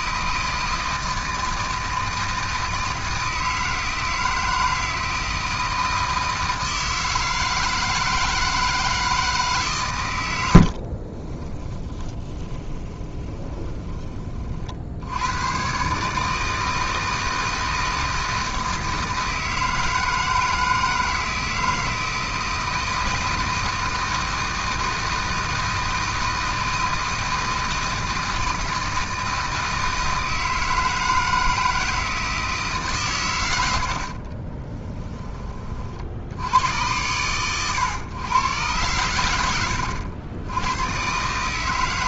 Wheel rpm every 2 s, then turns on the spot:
160, 160, 160, 160, 160, 50, 20, 60, 160, 160, 160, 160, 160, 160, 160, 160, 150, 30, 80, 110, 110.
10-14 34-36